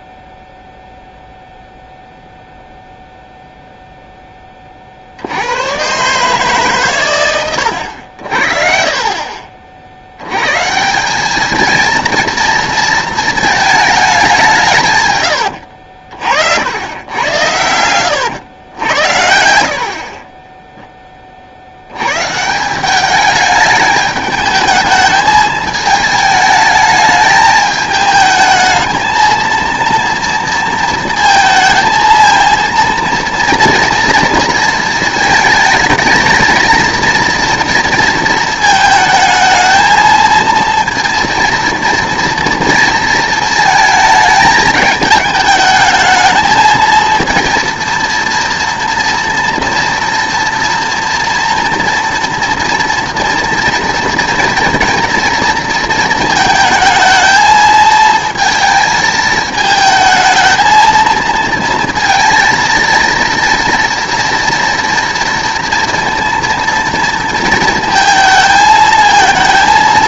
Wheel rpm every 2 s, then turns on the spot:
0, 0, 40, 140, 50, 140, 230, 180, 80, 80, 10, 180, 220, 210, 220, 230, 230, 230, 230, 220, 230, 230, 210, 220, 230, 230, 240, 230, 220, 220, 230, 230, 230, 230, 220.
none